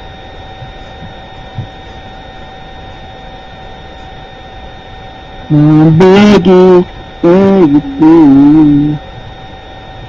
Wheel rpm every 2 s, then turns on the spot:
0, 0, 0, 0, 0.
none